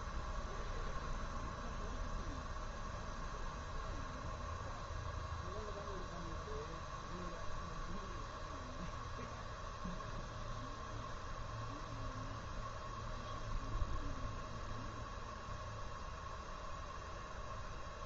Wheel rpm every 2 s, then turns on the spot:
0, 0, 0, 0, 0, 0, 0, 0, 0.
none